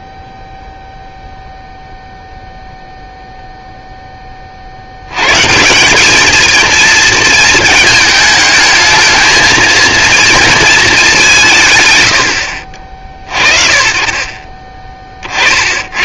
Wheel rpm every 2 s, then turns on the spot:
0, 0, 40, 220, 220, 230, 80, 30.
none